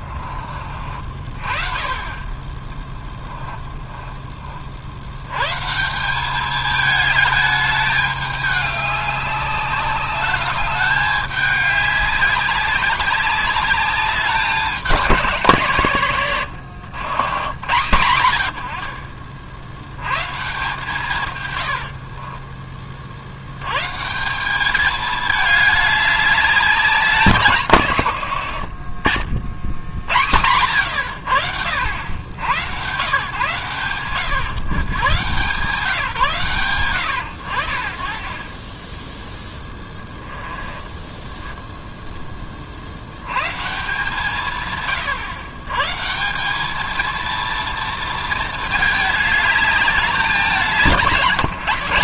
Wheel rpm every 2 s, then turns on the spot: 40, 20, 50, 210, 200, 210, 200, 190, 120, 70, 140, 40, 200, 200, 80, 90, 110, 120, 130, 30, 10, 40, 140, 200, 220, 170.
16-18 28-30 40-42